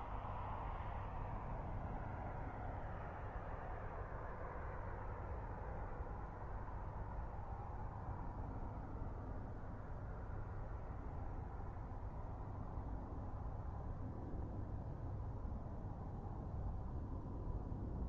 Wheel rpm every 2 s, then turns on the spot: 0, 0, 0, 0, 0, 0, 0, 0, 0.
none